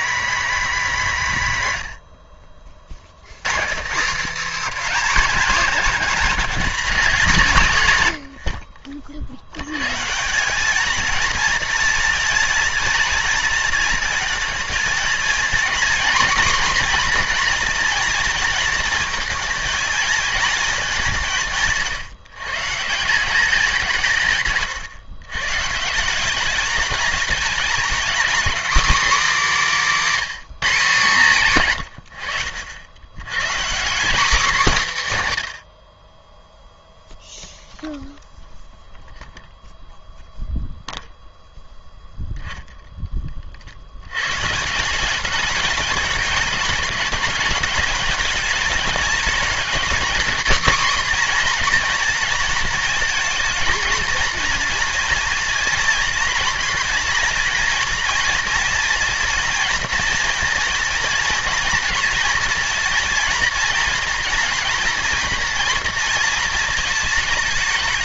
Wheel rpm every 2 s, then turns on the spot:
240, 60, 260, 210, 60, 210, 230, 230, 250, 230, 210, 170, 130, 200, 280, 230, 90, 230, 0, 0, 0, 0, 150, 210, 220, 260, 230, 230, 230, 240, 230, 230, 240, 220.
none